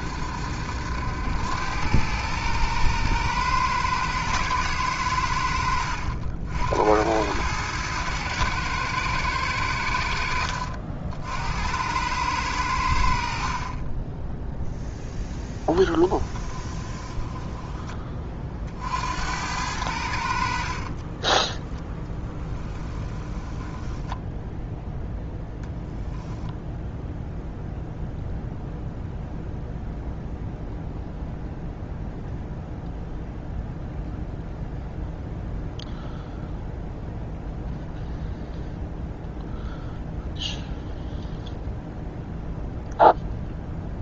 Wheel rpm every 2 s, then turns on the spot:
80, 110, 100, 80, 110, 60, 70, 0, 20, 60, 30, 10, 0, 0, 0, 0, 0, 0, 0, 0, 0, 0.
16-18 20-24